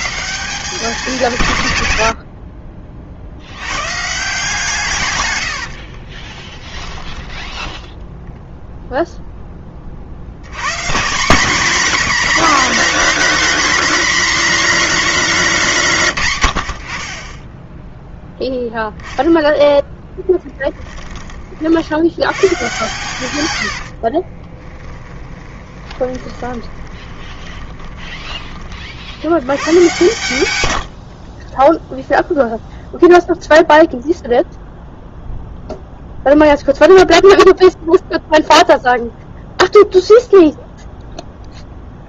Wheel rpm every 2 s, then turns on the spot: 200, 50, 130, 20, 0, 160, 260, 250, 40, 0, 20, 120, 20, 20, 50, 60, 0, 0, 0, 0, 0.
6-8 24-28 30-32